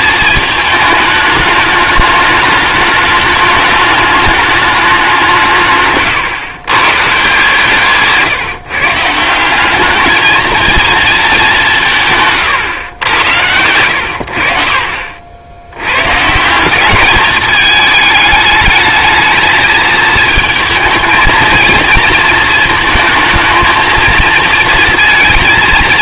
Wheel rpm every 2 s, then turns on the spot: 220, 210, 210, 140, 140, 220, 130, 70, 180, 220, 220, 230, 230.
12-14